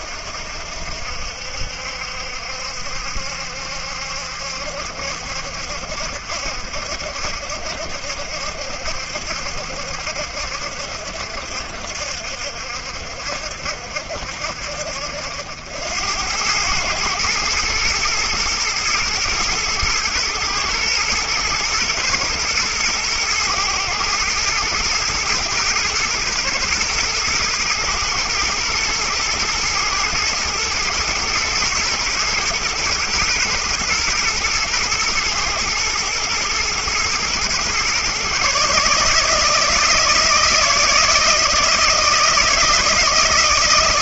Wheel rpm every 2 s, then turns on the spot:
70, 70, 70, 70, 70, 70, 60, 70, 100, 120, 120, 110, 120, 110, 120, 120, 120, 110, 120, 140, 160, 160.
none